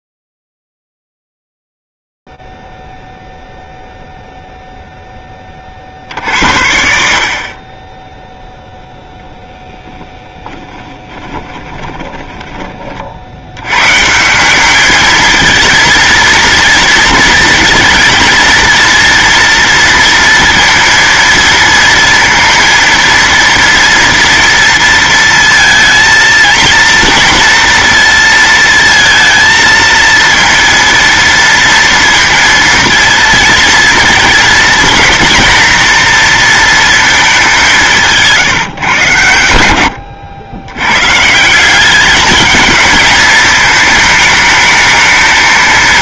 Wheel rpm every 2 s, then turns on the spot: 0, 0, 0, 60, 0, 10, 40, 210, 230, 230, 230, 230, 230, 230, 230, 230, 230, 230, 230, 120, 120, 220, 220.
10-12